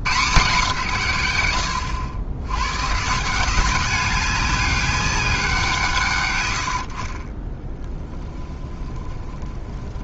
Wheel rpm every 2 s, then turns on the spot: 150, 140, 200, 70, 20.
8-10